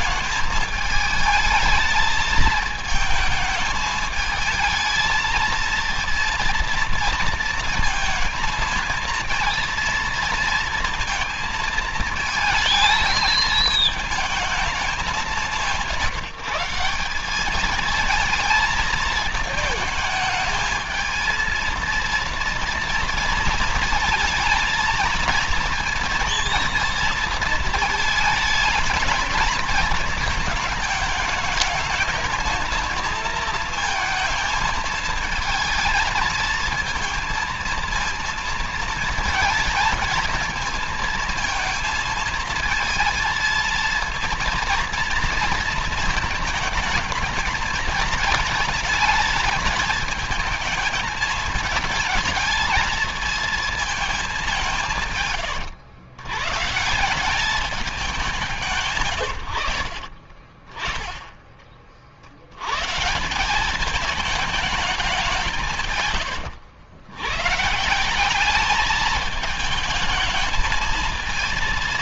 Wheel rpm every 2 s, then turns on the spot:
220, 220, 220, 230, 220, 230, 220, 220, 170, 220, 220, 230, 230, 230, 220, 220, 220, 220, 230, 230, 220, 220, 230, 220, 220, 210, 220, 200, 120, 160, 20, 90, 210, 90, 200, 220.
none